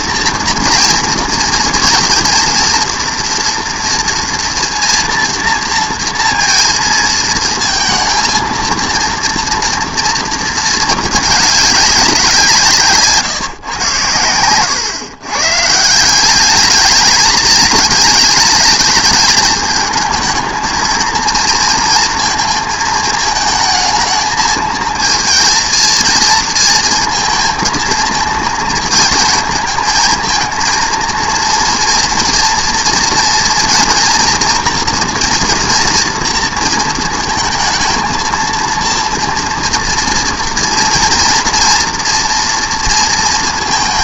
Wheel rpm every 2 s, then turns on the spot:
230, 230, 230, 230, 220, 230, 170, 110, 200, 210, 220, 220, 220, 230, 220, 230, 230, 230, 230, 230, 230, 230.
none